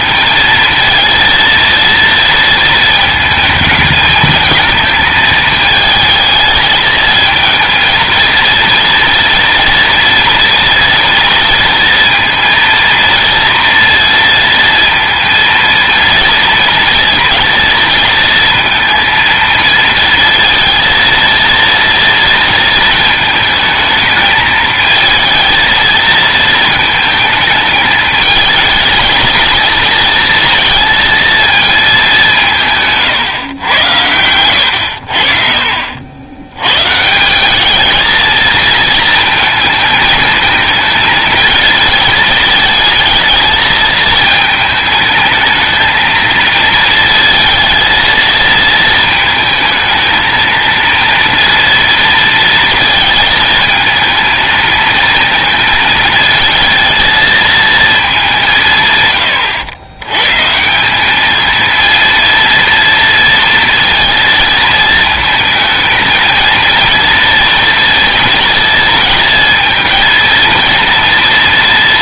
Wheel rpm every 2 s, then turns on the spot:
230, 220, 220, 220, 230, 230, 230, 230, 230, 230, 230, 230, 220, 220, 230, 230, 150, 90, 120, 230, 230, 220, 220, 230, 220, 230, 230, 220, 220, 150, 180, 230, 220, 230, 230, 230.
none